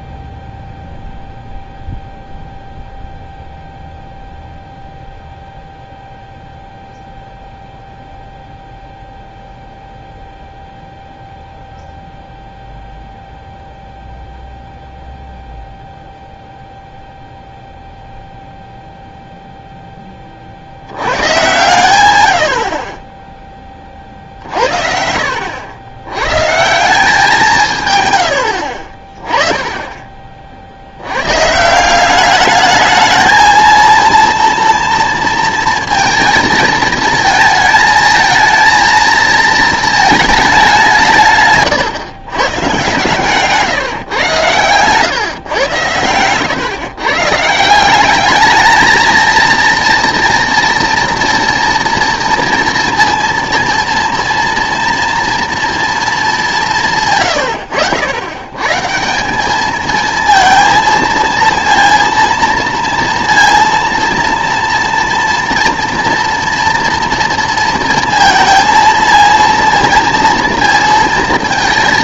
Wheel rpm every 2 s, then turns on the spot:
0, 0, 0, 0, 0, 0, 0, 0, 0, 0, 70, 60, 60, 150, 60, 60, 210, 230, 230, 230, 200, 130, 120, 130, 220, 230, 230, 230, 180, 130, 230, 230, 230, 230, 230, 230.
none